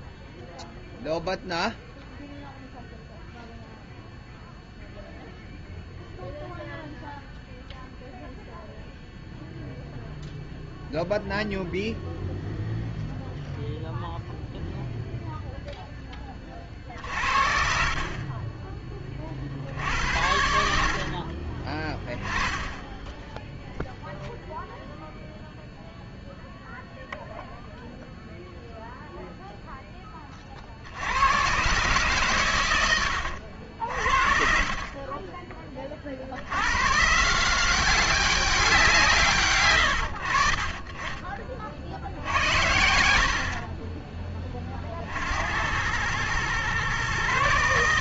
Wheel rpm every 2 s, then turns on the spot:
0, 0, 0, 0, 0, 0, 0, 0, 40, 20, 60, 20, 0, 0, 0, 40, 100, 30, 110, 190, 40, 80, 30, 120.
18-20 22-24